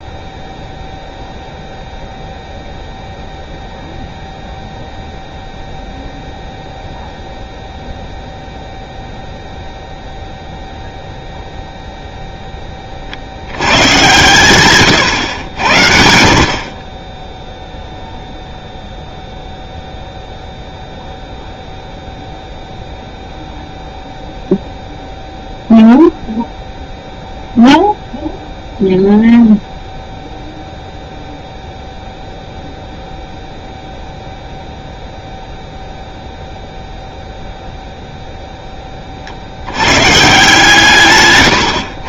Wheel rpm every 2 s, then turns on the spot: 0, 0, 0, 0, 0, 0, 20, 120, 40, 0, 0, 0, 0, 0, 0, 0, 0, 0, 0, 10, 150.
none